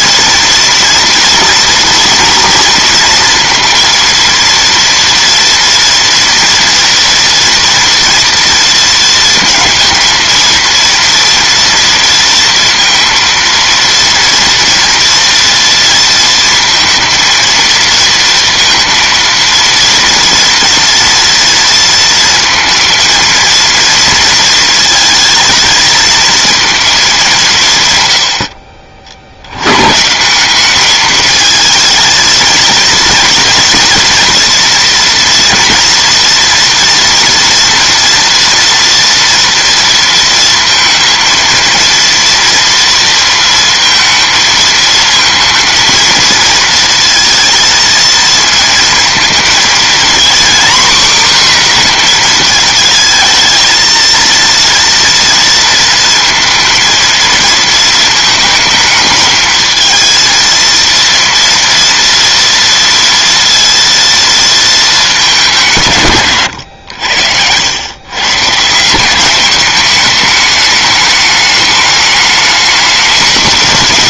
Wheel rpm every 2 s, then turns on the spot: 230, 230, 230, 230, 230, 230, 230, 230, 230, 230, 230, 230, 230, 220, 60, 200, 230, 230, 230, 230, 230, 230, 220, 230, 230, 250, 220, 230, 230, 220, 230, 230, 230, 110, 160, 210, 210.
none